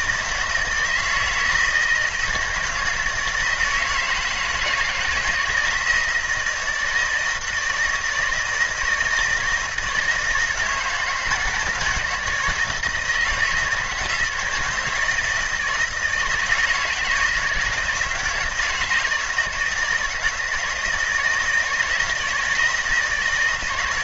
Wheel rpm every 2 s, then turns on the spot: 160, 170, 170, 160, 160, 160, 160, 160, 160, 160, 160, 160.
none